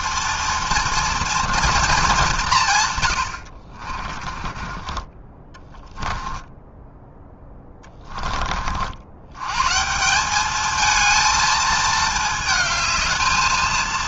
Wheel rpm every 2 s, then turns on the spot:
230, 170, 30, 10, 40, 210, 220.
4-8